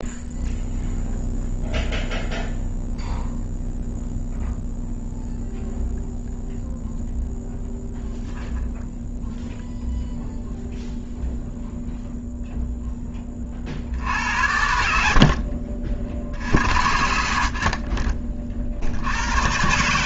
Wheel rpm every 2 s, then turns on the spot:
0, 0, 0, 0, 0, 0, 0, 70, 60, 50.
none